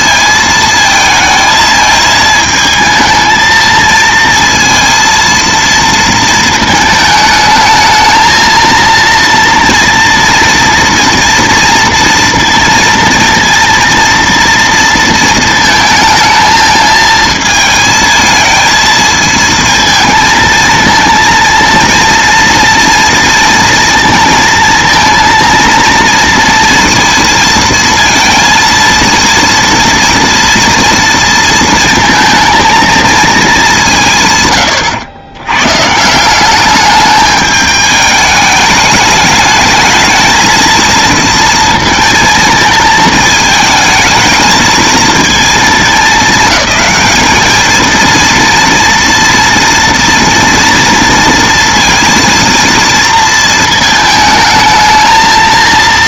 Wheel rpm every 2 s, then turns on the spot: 220, 220, 230, 220, 230, 230, 230, 230, 220, 220, 230, 230, 230, 230, 230, 230, 230, 130, 190, 210, 230, 220, 220, 210, 230, 230, 230, 220.
none